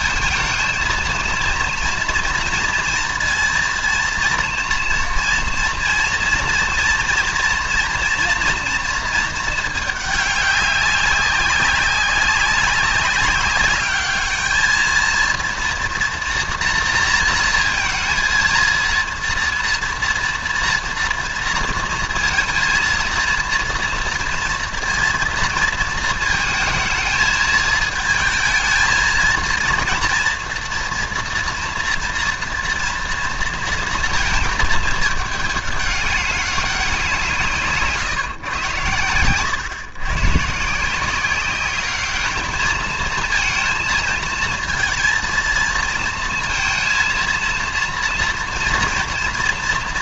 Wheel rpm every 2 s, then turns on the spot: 230, 230, 230, 230, 230, 200, 190, 220, 230, 230, 230, 230, 230, 220, 220, 230, 230, 220, 190, 110, 150, 220, 230, 230, 230.
none